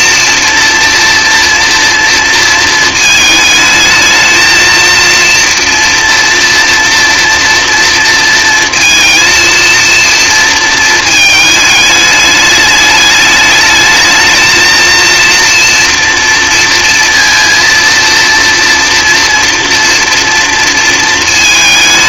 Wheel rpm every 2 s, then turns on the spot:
230, 220, 230, 230, 230, 230, 210, 220, 230, 240, 230.
none